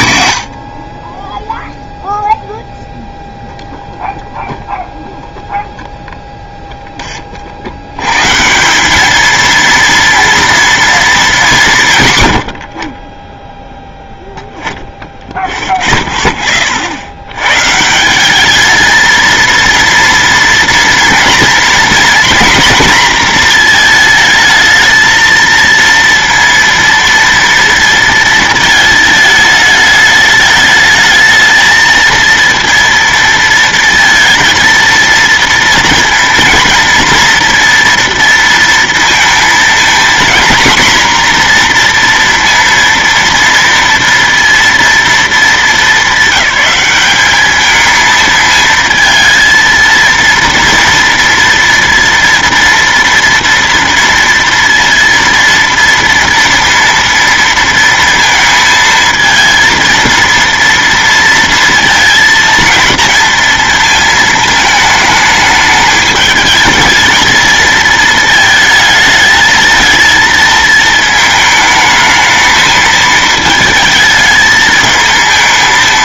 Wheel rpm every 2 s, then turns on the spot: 50, 0, 0, 10, 200, 230, 40, 0, 50, 230, 230, 230, 220, 230, 220, 220, 230, 230, 230, 230, 250, 230, 230, 210, 220, 230, 230, 230, 230, 220, 230, 230, 220, 220, 220, 220, 220, 220.
none